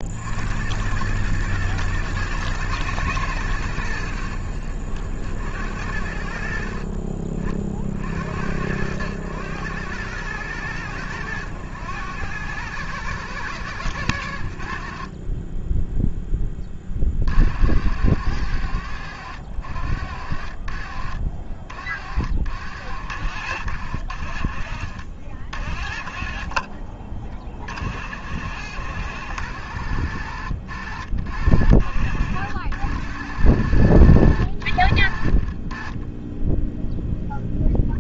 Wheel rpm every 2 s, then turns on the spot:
90, 110, 60, 50, 90, 110, 110, 60, 30, 90, 60, 80, 50, 40, 80, 80, 80, 70, 0.
none